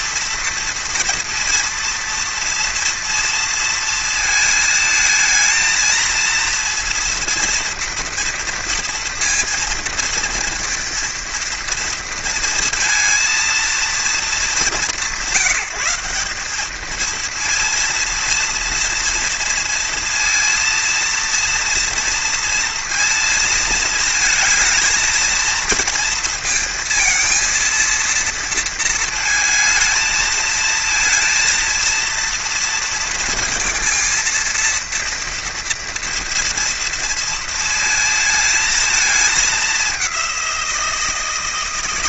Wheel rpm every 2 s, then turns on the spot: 230, 230, 220, 230, 230, 230, 230, 190, 220, 230, 230, 230, 230, 230, 230, 230, 230, 230, 230, 220, 170.
none